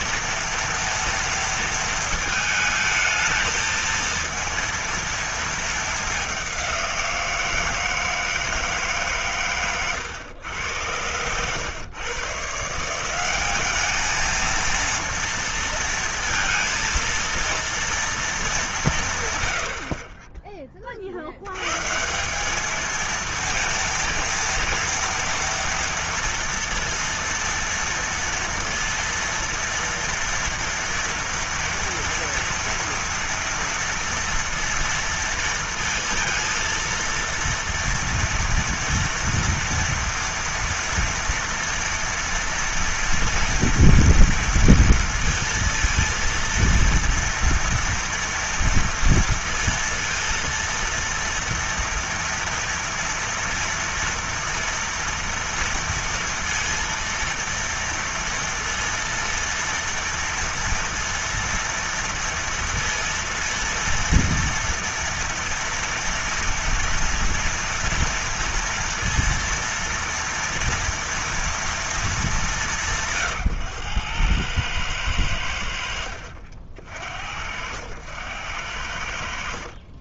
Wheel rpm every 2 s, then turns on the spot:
230, 230, 230, 210, 160, 110, 120, 210, 230, 230, 60, 150, 230, 230, 230, 230, 230, 230, 230, 230, 230, 230, 230, 230, 230, 230, 230, 230, 230, 230, 230, 230, 230, 230, 230, 230, 210, 100, 80, 80.
none